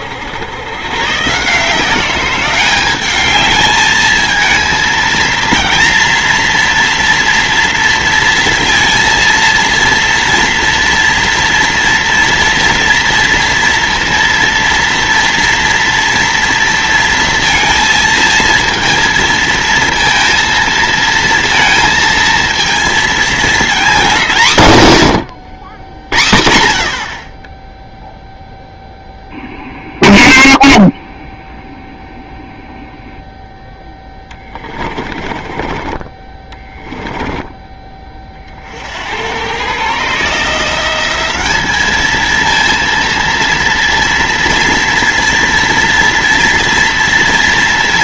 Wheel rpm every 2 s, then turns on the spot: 120, 200, 230, 230, 230, 230, 230, 230, 230, 230, 230, 230, 150, 40, 0, 0, 0, 30, 20, 80, 180, 230, 230, 230.
34-38